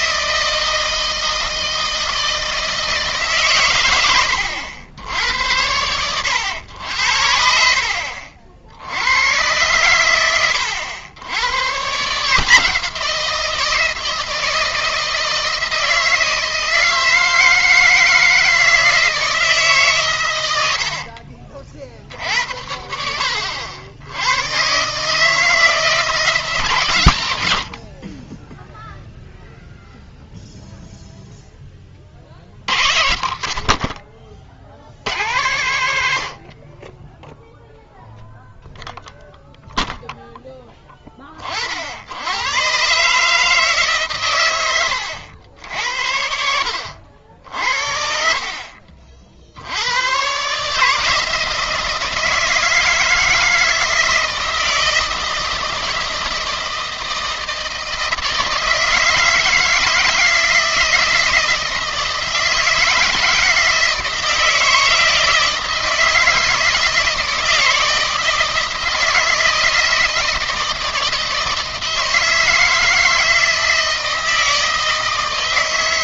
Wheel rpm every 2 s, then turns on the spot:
160, 160, 90, 80, 70, 90, 160, 160, 160, 160, 70, 70, 130, 150, 0, 0, 70, 70, 30, 0, 10, 120, 100, 80, 50, 150, 160, 160, 160, 160, 160, 160, 160, 160, 160, 160, 160, 160.
20-22 44-46